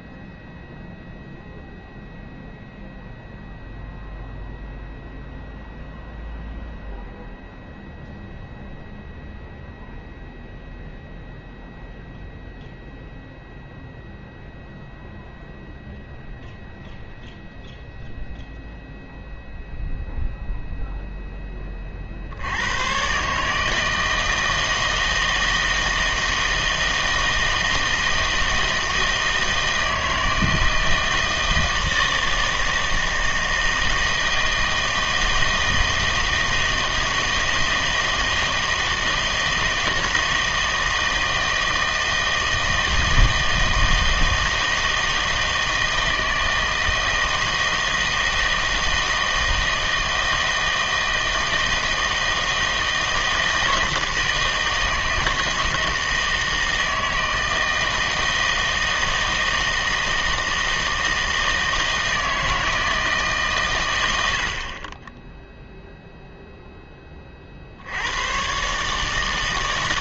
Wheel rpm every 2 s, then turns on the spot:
0, 0, 0, 0, 0, 0, 0, 0, 0, 0, 0, 100, 160, 160, 160, 160, 160, 160, 160, 160, 160, 160, 160, 160, 160, 160, 160, 160, 160, 160, 160, 160, 60, 0, 130.
none